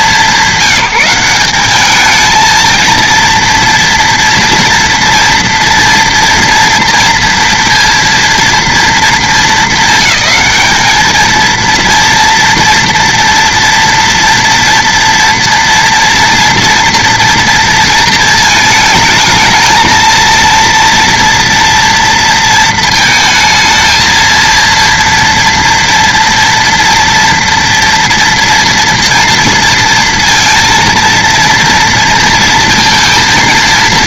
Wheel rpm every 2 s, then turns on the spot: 190, 230, 230, 240, 230, 200, 230, 240, 240, 220, 230, 230, 230, 230, 230, 230, 230.
none